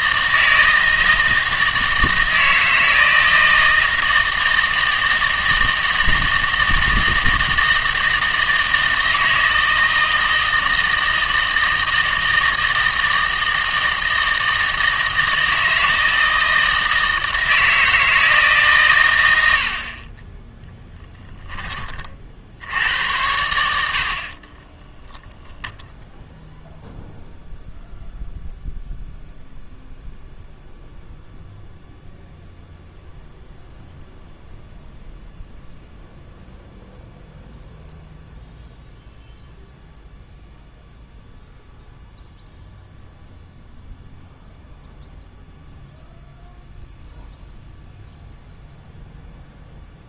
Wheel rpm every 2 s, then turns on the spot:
160, 160, 160, 160, 160, 160, 160, 160, 160, 140, 10, 80, 10, 0, 0, 0, 0, 0, 0, 0, 0, 0, 0, 0, 0.
24-26